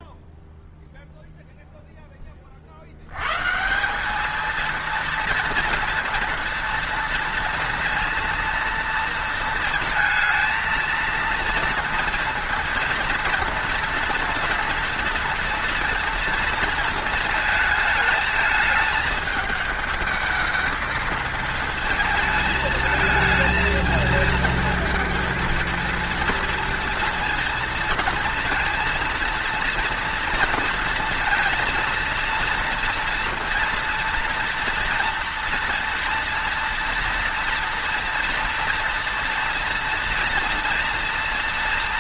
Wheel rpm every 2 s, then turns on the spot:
0, 30, 220, 230, 230, 230, 230, 230, 230, 220, 220, 220, 230, 230, 230, 230, 230, 230, 230, 230, 230.
none